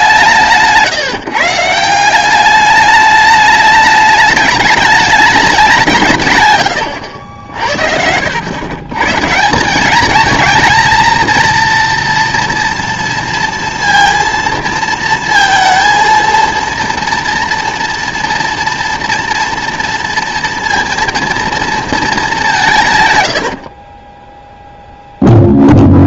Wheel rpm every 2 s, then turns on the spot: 160, 200, 210, 120, 100, 220, 230, 230, 230, 230, 230, 180, 0.
none